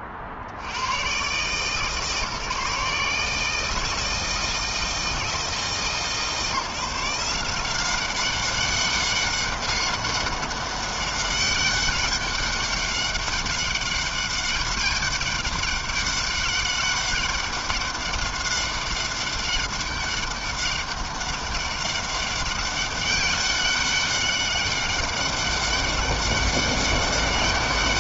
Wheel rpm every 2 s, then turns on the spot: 70, 150, 160, 160, 190, 200, 200, 200, 200, 200, 200, 200, 200, 200.
none